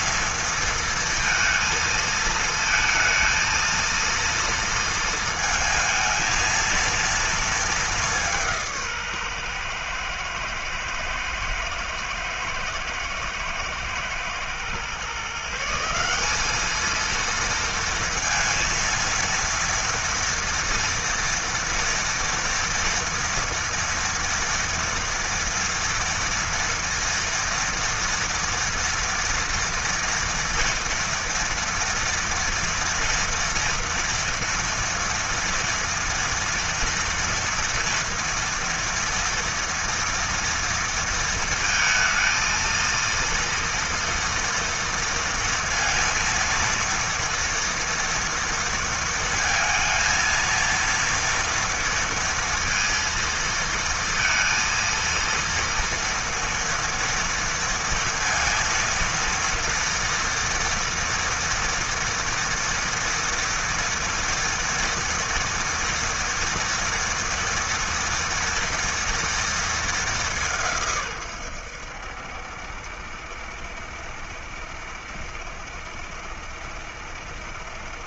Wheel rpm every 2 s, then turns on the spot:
230, 220, 230, 220, 140, 110, 120, 150, 230, 230, 230, 230, 230, 230, 230, 240, 230, 230, 230, 230, 230, 230, 230, 230, 230, 230, 230, 230, 230, 230, 230, 230, 230, 230, 230, 130, 70, 70, 70.
none